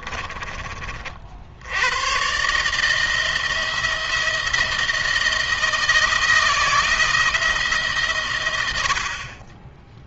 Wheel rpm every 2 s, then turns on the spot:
30, 150, 170, 160, 100.
none